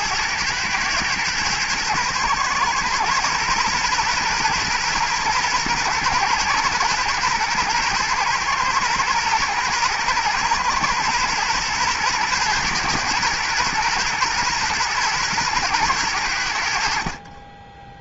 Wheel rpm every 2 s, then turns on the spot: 110, 120, 120, 120, 120, 120, 120, 120, 60.
none